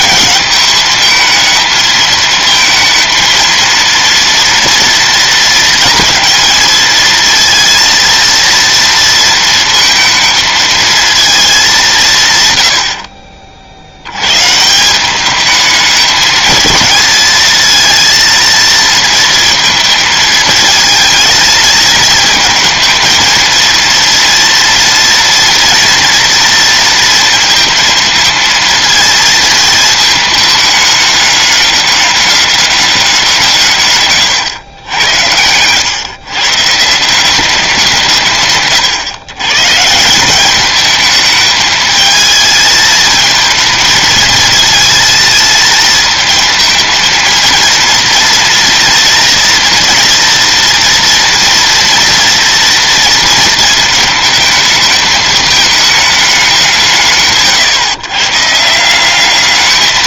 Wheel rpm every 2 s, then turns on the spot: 220, 220, 230, 230, 230, 220, 50, 180, 220, 230, 220, 220, 230, 230, 230, 210, 190, 90, 160, 120, 210, 220, 220, 220, 230, 230, 230, 220, 150, 180.
none